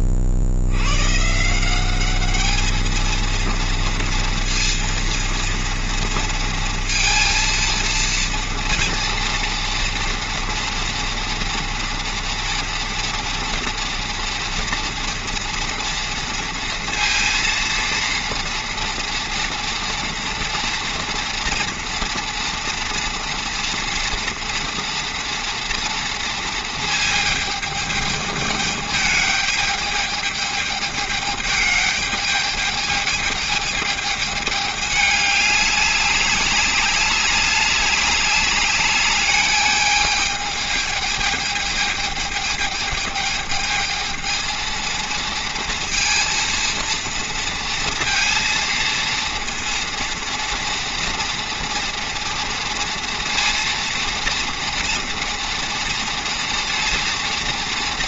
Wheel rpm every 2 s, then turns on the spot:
60, 210, 230, 230, 230, 240, 230, 230, 230, 230, 230, 240, 230, 220, 220, 220, 210, 210, 210, 210, 210, 210, 220, 230, 230, 230, 230, 230, 230.
none